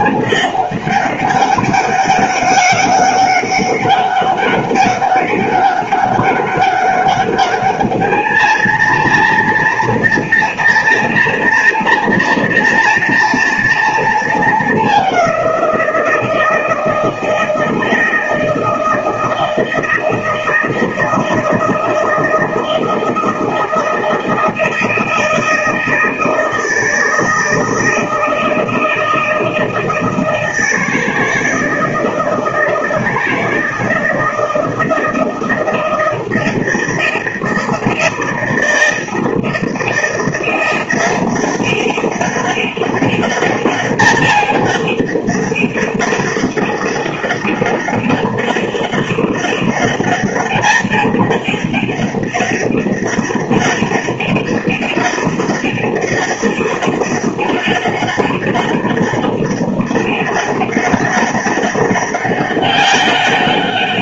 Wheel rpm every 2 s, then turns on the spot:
200, 200, 200, 190, 220, 230, 230, 220, 160, 160, 160, 160, 160, 160, 160, 160, 160, 160, 160, 160, 170, 200, 210, 200, 200, 210, 200, 200, 200, 200, 200, 200.
none